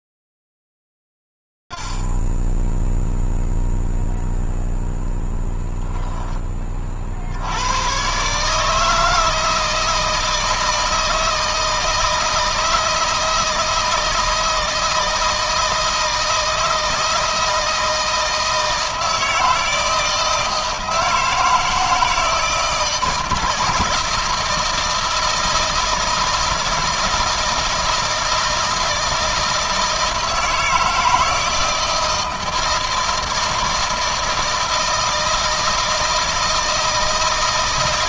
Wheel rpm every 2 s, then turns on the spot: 60, 80, 0, 10, 90, 160, 160, 160, 160, 160, 160, 160, 170, 160, 160, 160, 160, 160, 160.
none